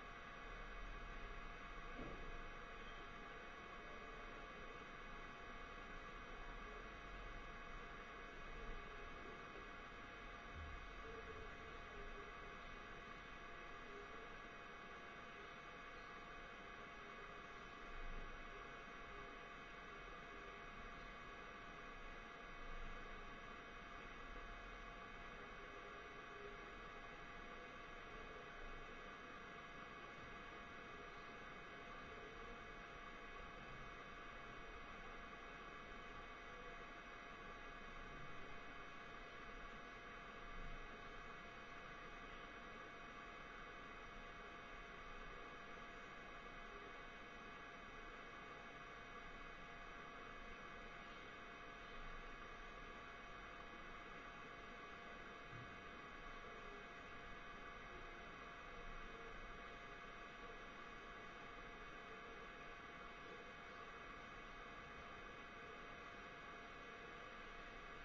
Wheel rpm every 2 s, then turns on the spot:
0, 0, 0, 0, 0, 0, 0, 0, 0, 0, 0, 0, 0, 0, 0, 0, 0, 0, 0, 0, 0, 0, 0, 0, 0, 0, 0, 0, 0, 0, 0, 0, 0, 0.
none